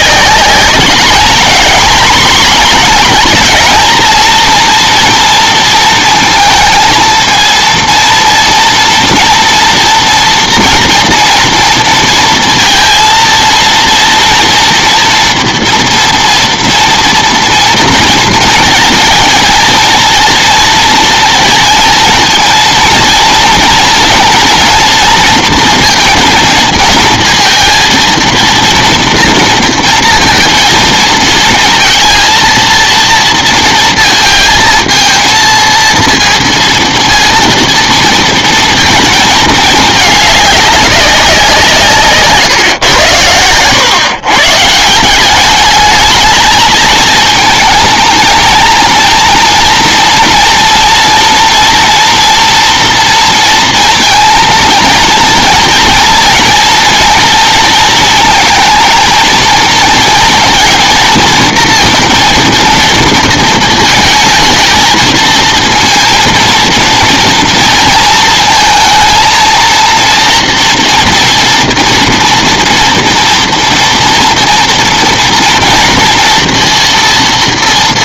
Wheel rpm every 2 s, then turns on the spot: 210, 230, 230, 230, 240, 240, 230, 230, 230, 230, 230, 230, 230, 230, 230, 230, 230, 230, 230, 220, 200, 120, 160, 220, 230, 230, 230, 230, 230, 230, 230, 230, 220, 230, 230, 230, 240, 230, 230.
none